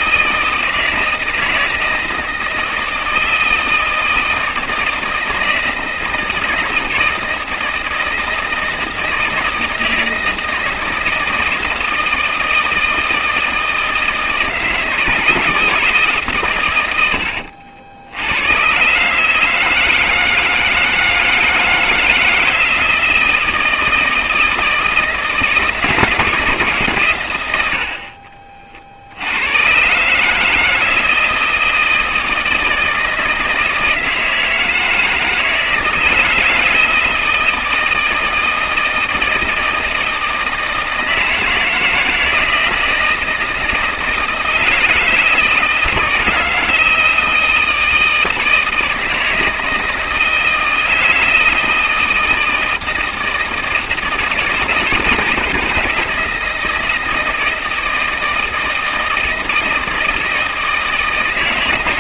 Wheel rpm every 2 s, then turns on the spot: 160, 160, 160, 160, 160, 160, 160, 160, 100, 120, 160, 160, 160, 150, 50, 160, 160, 160, 160, 160, 160, 160, 160, 160, 160, 160, 160, 160, 160, 160, 160.
none